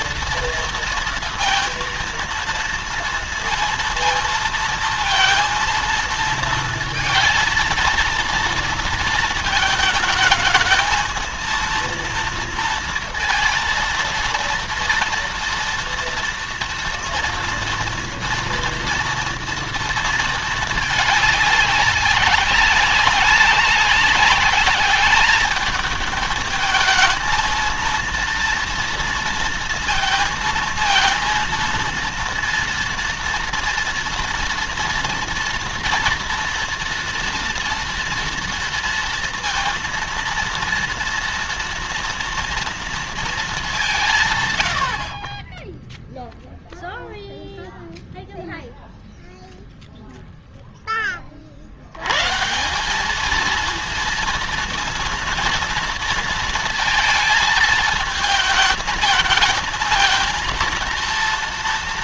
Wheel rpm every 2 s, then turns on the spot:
230, 230, 230, 230, 230, 220, 230, 230, 240, 240, 210, 200, 210, 220, 230, 230, 230, 230, 230, 230, 230, 230, 80, 0, 0, 10, 190, 230, 230, 220, 230.
none